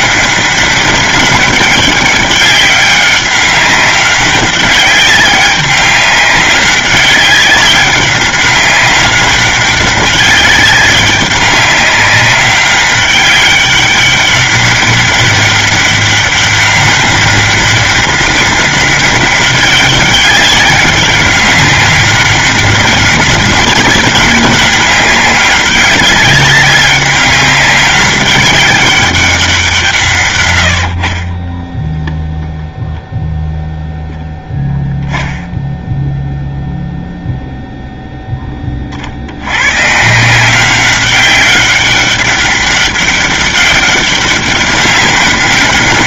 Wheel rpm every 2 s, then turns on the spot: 200, 200, 190, 190, 190, 200, 200, 200, 200, 200, 190, 200, 200, 200, 200, 90, 0, 0, 0, 30, 190, 190, 200.
none